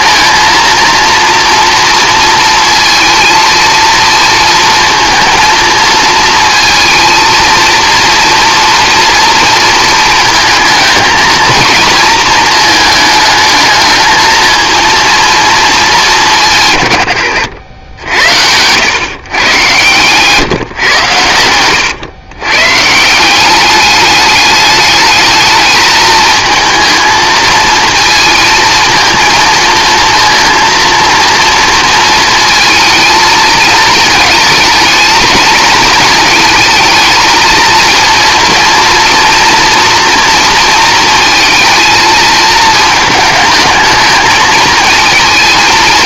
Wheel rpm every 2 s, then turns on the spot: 230, 230, 230, 230, 240, 230, 220, 220, 120, 110, 130, 140, 210, 220, 230, 230, 220, 220, 220, 240, 230, 220, 230.
none